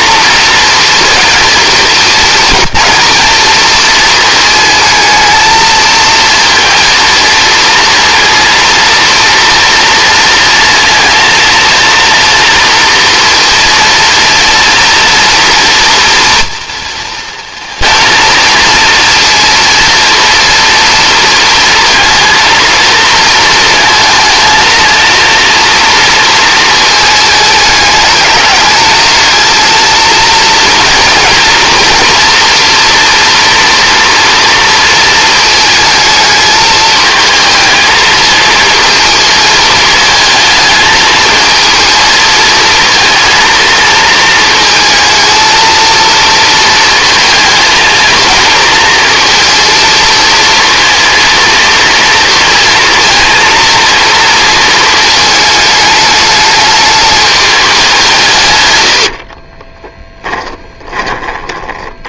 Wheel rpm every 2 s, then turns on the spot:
230, 220, 220, 230, 230, 230, 230, 230, 230, 230, 230, 230, 220, 220, 210, 230, 230, 230, 220, 220, 220, 220, 220, 220, 230, 230, 230, 220, 210, 100, 10.
58-62